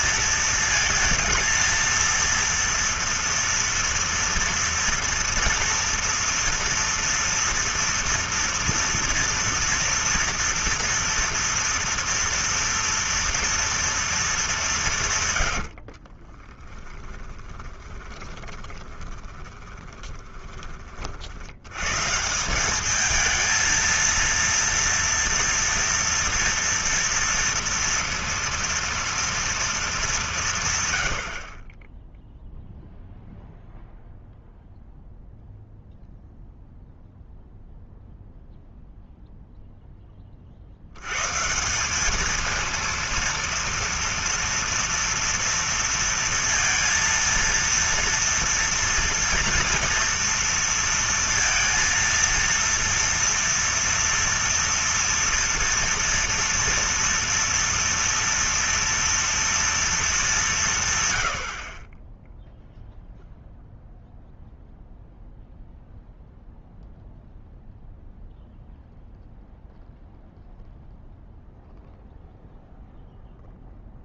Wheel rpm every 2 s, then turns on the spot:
230, 240, 230, 240, 230, 230, 230, 190, 20, 20, 40, 190, 230, 230, 230, 160, 0, 0, 0, 0, 50, 220, 230, 230, 230, 230, 230, 230, 230, 230, 180, 0, 0, 0, 0, 0, 0.
16-20